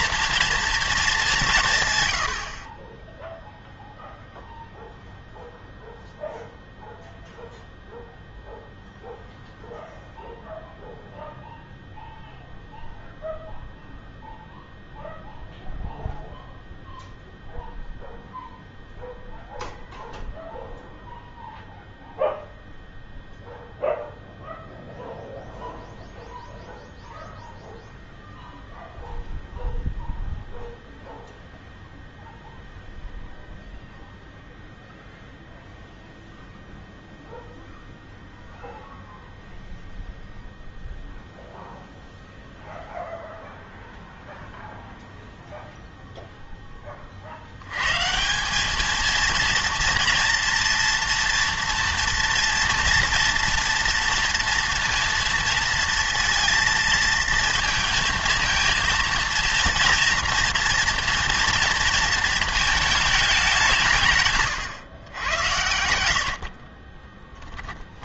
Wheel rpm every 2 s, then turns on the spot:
230, 40, 0, 0, 0, 0, 0, 0, 0, 0, 0, 0, 0, 0, 0, 0, 0, 0, 0, 0, 0, 0, 0, 10, 200, 230, 230, 230, 230, 230, 230, 220, 130, 60.
64-68